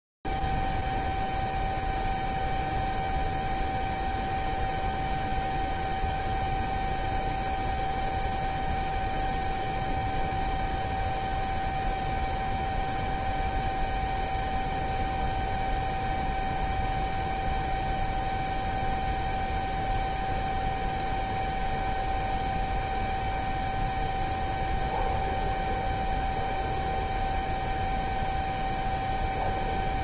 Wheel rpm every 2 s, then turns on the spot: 0, 0, 0, 0, 0, 0, 0, 0, 0, 0, 0, 0, 0, 0, 0.
none